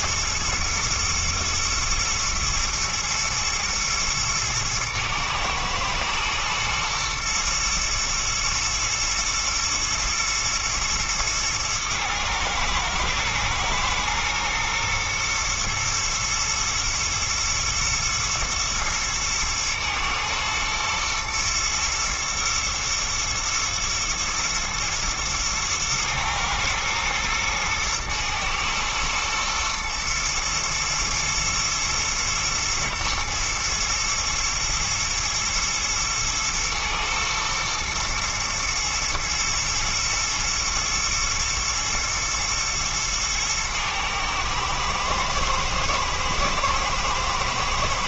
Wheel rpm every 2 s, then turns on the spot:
110, 110, 110, 110, 120, 110, 110, 120, 120, 110, 110, 120, 120, 110, 110, 110, 120, 120, 110, 120, 120, 110, 110, 110.
none